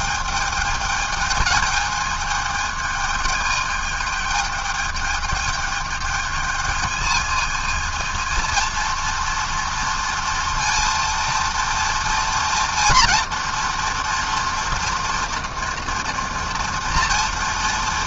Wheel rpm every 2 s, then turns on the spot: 210, 220, 220, 220, 230, 230, 230, 230, 230.
none